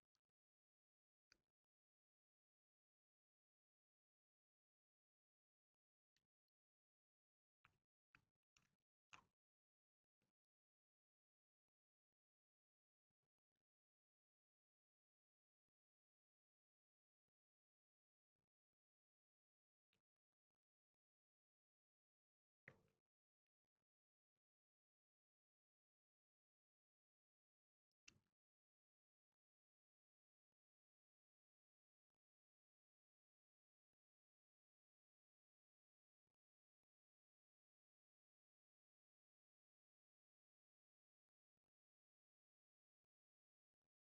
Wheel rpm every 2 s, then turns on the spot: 0, 0, 0, 0, 0, 0, 0, 0, 0, 0, 0, 0, 0, 0, 0, 0, 0, 0, 0, 0, 0, 0.
none